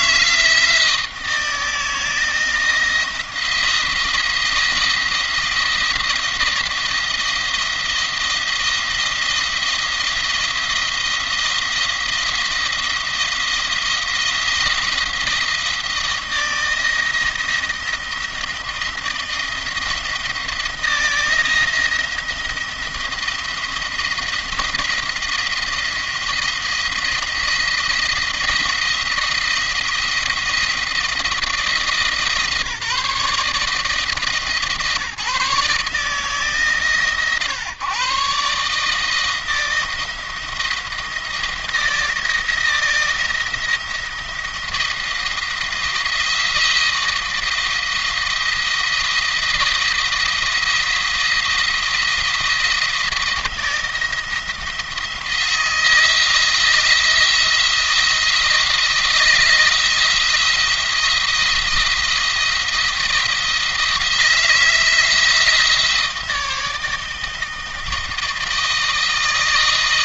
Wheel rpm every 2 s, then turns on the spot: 160, 170, 170, 170, 170, 170, 170, 160, 170, 170, 170, 170, 170, 170, 170, 170, 160, 160, 140, 150, 170, 170, 170, 170, 170, 170, 160, 160, 170, 160, 170, 170, 160, 160, 160.
none